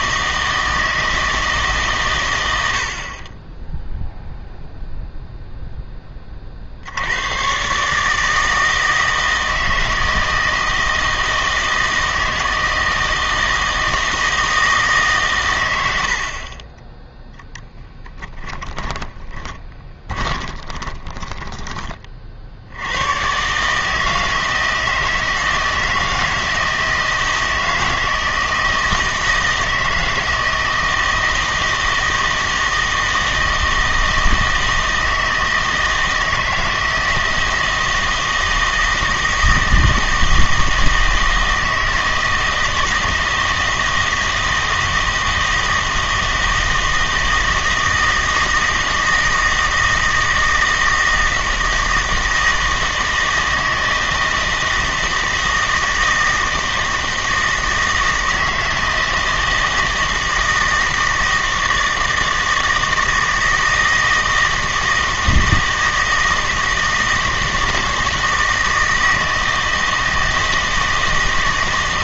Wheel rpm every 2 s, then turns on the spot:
160, 70, 0, 50, 160, 160, 160, 160, 20, 20, 20, 80, 160, 160, 160, 160, 160, 160, 160, 160, 160, 160, 160, 160, 160, 160, 160, 160, 160, 160, 160, 160, 160, 160, 160, 160.
18-22